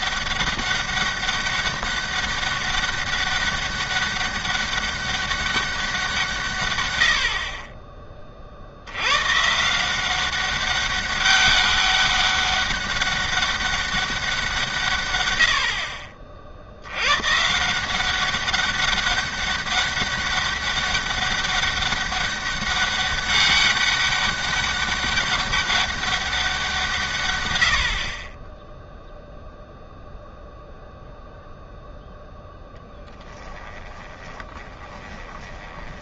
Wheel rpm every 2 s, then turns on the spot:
200, 200, 200, 120, 70, 200, 200, 170, 70, 200, 200, 200, 200, 180, 10, 0, 10, 20.
32-36